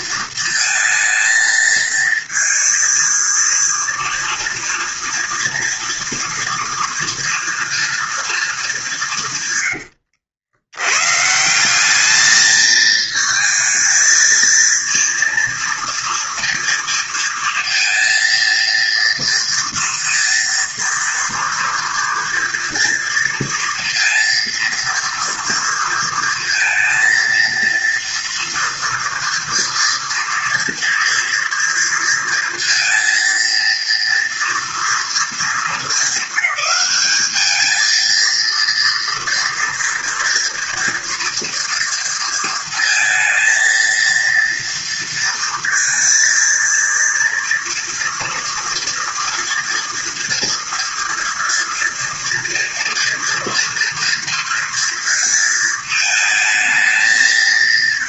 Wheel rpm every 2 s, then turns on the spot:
230, 230, 230, 230, 220, 80, 220, 230, 230, 230, 230, 240, 230, 230, 230, 230, 230, 230, 200, 230, 230, 230, 230, 230, 230, 230, 240, 230, 220.
none